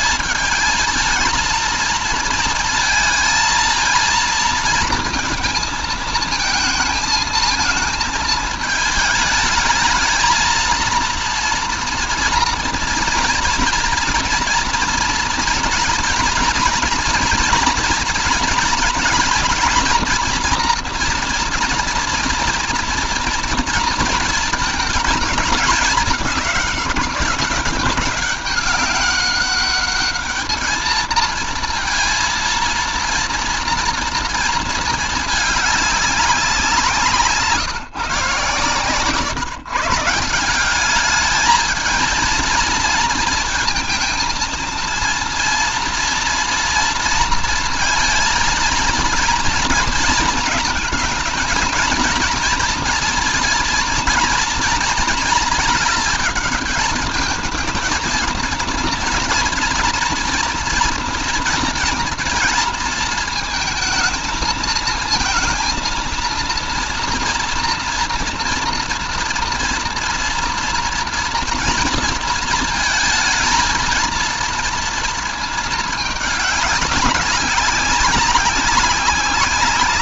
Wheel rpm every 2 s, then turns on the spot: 210, 220, 230, 220, 220, 220, 230, 240, 240, 230, 240, 230, 220, 200, 200, 210, 230, 230, 200, 150, 170, 220, 230, 230, 230, 220, 230, 230, 220, 230, 230, 230, 220, 230, 230, 230, 230, 230, 210, 190.
none